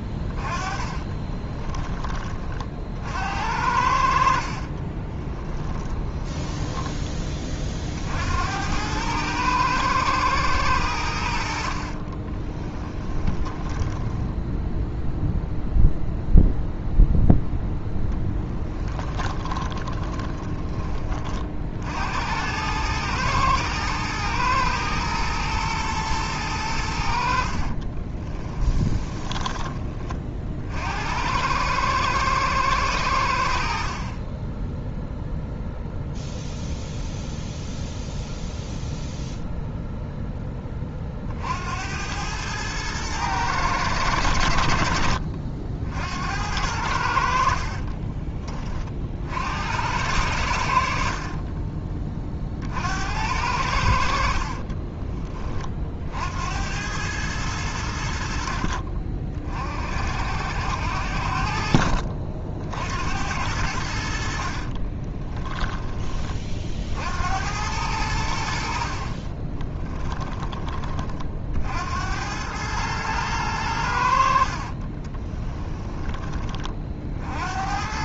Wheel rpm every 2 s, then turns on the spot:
20, 50, 30, 20, 100, 90, 10, 0, 0, 10, 20, 100, 110, 90, 20, 60, 110, 10, 0, 0, 30, 110, 70, 80, 40, 70, 60, 30, 90, 50, 80, 80, 40, 50, 50, 20, 110, 30, 40.
0-2 4-8 12-14 18-20 28-30 54-56 58-60 64-66 74-76